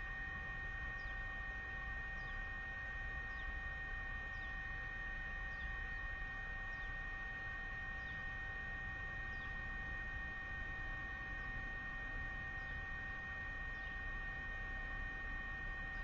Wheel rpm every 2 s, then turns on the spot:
0, 0, 0, 0, 0, 0, 0, 0.
none